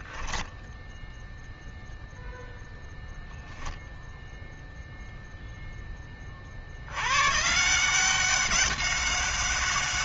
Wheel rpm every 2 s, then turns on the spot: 0, 0, 0, 130, 190.
none